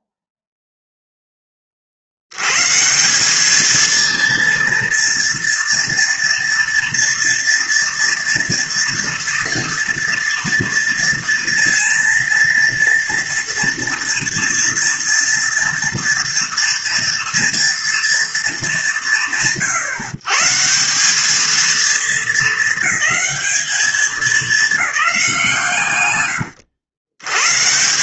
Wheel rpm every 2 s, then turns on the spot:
10, 200, 230, 230, 230, 230, 240, 230, 240, 120, 210, 220, 180, 130.
none